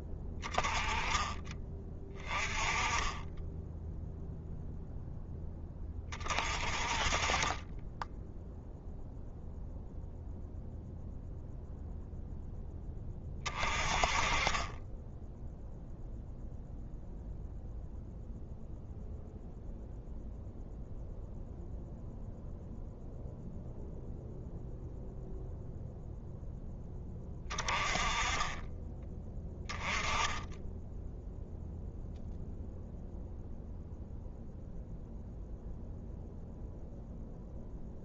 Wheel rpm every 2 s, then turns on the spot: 30, 20, 0, 30, 0, 0, 10, 10, 0, 0, 0, 0, 0, 10, 20, 10, 0, 0, 0.
none